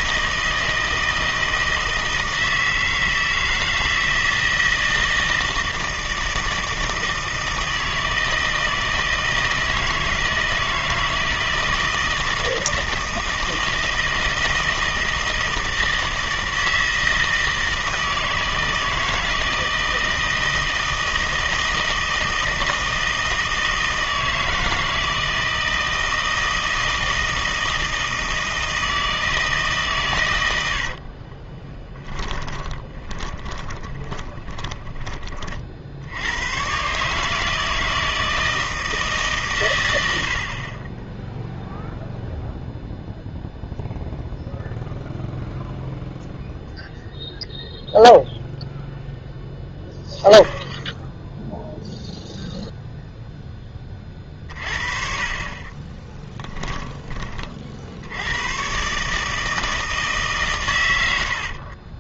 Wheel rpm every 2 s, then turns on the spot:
160, 160, 160, 160, 160, 160, 160, 160, 160, 160, 160, 160, 160, 160, 160, 90, 20, 20, 110, 160, 40, 0, 0, 0, 0, 0, 0, 40, 10, 120, 130.
32-36 56-58